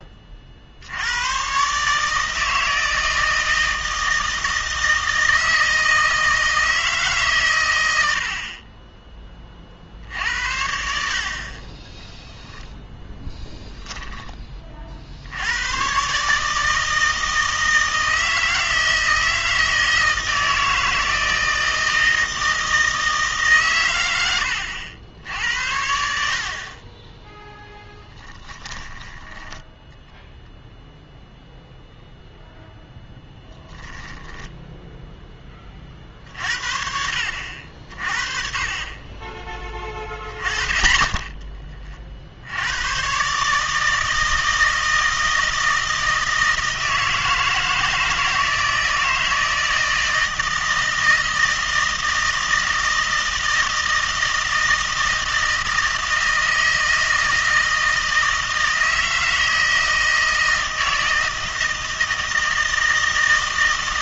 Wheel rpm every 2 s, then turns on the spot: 80, 160, 160, 160, 20, 70, 10, 40, 160, 160, 160, 160, 90, 30, 10, 0, 0, 0, 60, 30, 20, 110, 160, 160, 160, 160, 160, 160, 160, 160, 160, 160.
28-30